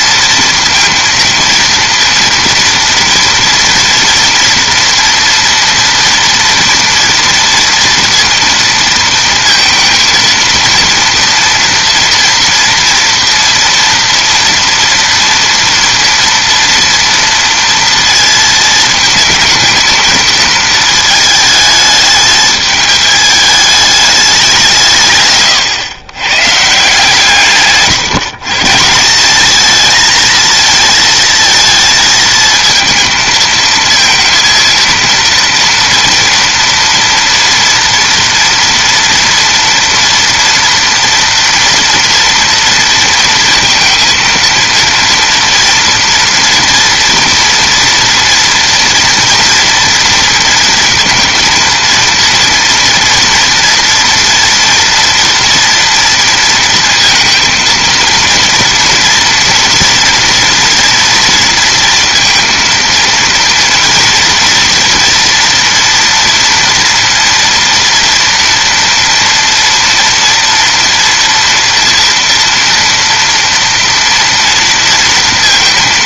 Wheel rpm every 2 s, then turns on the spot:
230, 230, 230, 230, 230, 230, 230, 230, 230, 220, 220, 210, 170, 150, 150, 220, 220, 230, 230, 230, 230, 230, 230, 230, 230, 230, 240, 240, 230, 230, 240, 230, 230, 230, 230, 230, 230, 230.
none